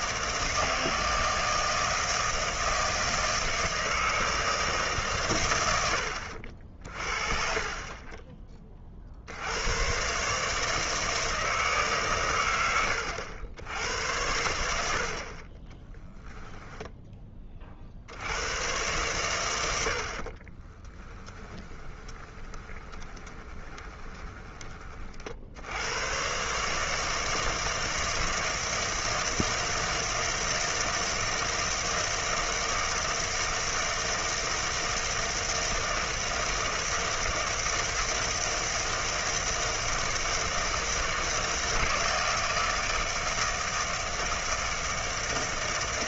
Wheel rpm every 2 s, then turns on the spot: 160, 160, 160, 60, 20, 150, 110, 80, 10, 110, 30, 20, 20, 140, 160, 160, 160, 160, 160, 160, 160, 160, 160.
20-24